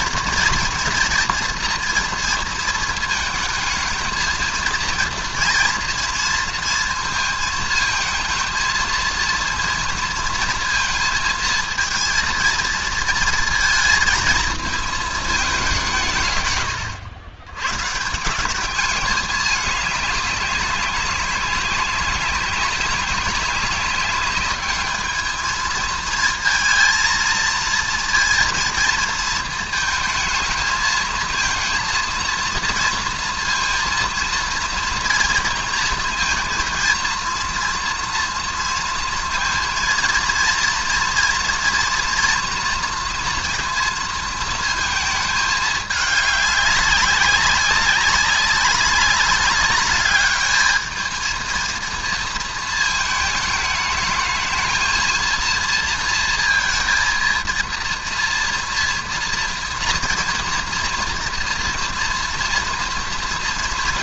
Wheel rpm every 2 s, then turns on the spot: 240, 230, 230, 230, 220, 230, 230, 230, 140, 180, 200, 190, 200, 230, 230, 220, 230, 230, 220, 230, 230, 230, 220, 200, 200, 210, 230, 220, 230, 240, 230, 230.
none